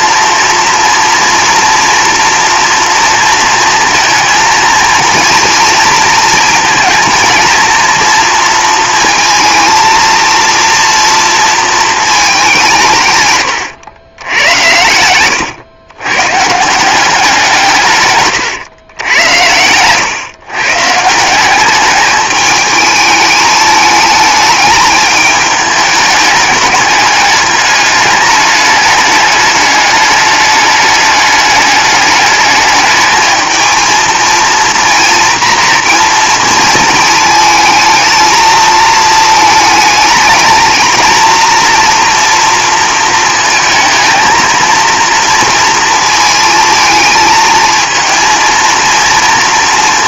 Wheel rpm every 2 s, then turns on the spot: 230, 240, 230, 230, 230, 230, 170, 100, 170, 100, 140, 210, 210, 210, 210, 210, 210, 240, 230, 220, 220, 230, 230, 220, 230.
none